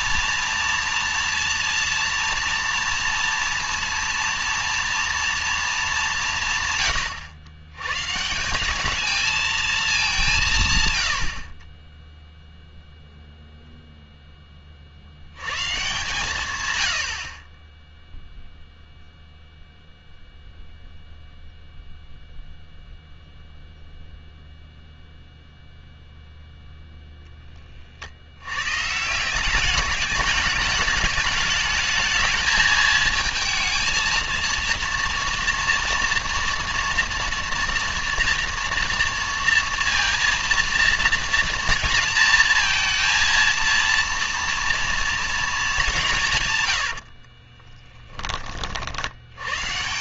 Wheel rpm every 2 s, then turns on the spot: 230, 230, 230, 140, 200, 140, 0, 40, 110, 0, 0, 0, 0, 0, 130, 210, 220, 230, 240, 230, 230, 230, 230, 100, 50.
46-48